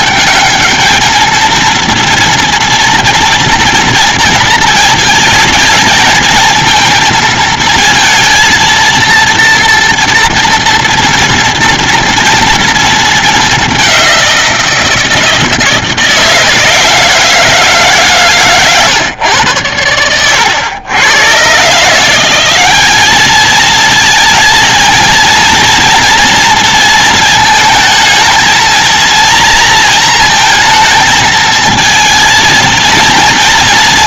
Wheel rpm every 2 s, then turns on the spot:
210, 230, 230, 220, 230, 240, 230, 190, 160, 140, 90, 170, 230, 230, 220, 230, 220.
none